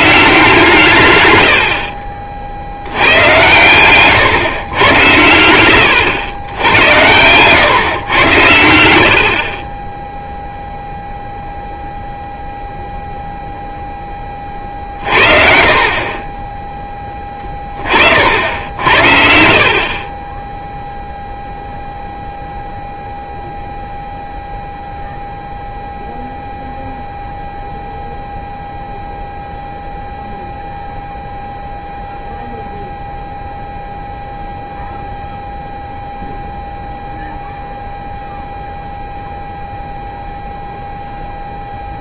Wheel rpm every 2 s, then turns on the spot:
150, 80, 110, 100, 80, 0, 0, 30, 20, 70, 10, 0, 0, 0, 0, 0, 0, 0, 0, 0, 0.
18-22